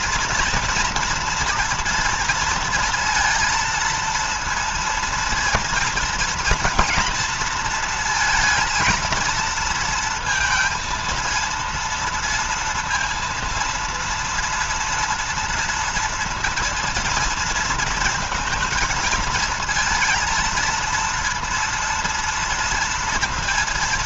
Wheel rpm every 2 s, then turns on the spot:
240, 230, 230, 230, 230, 230, 230, 230, 230, 220, 230, 230.
none